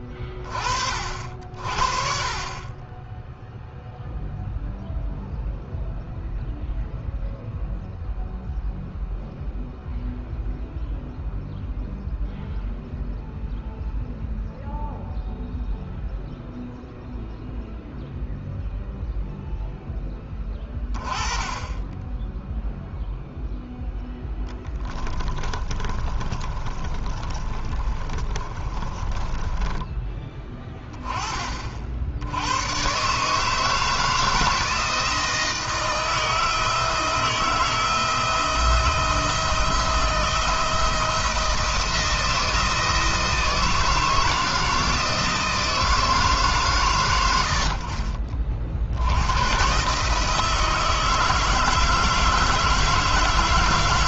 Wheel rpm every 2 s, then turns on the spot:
40, 0, 0, 0, 0, 0, 0, 0, 0, 0, 20, 0, 30, 50, 20, 30, 150, 160, 170, 170, 160, 160, 160, 90, 100, 160, 160.
24-30